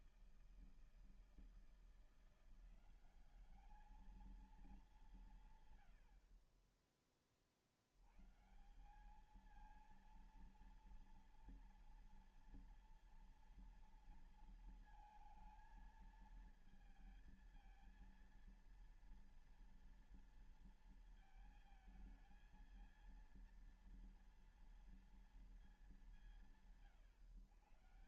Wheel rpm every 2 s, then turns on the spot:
160, 170, 220, 60, 150, 230, 230, 230, 220, 230, 230, 220, 230, 160.
none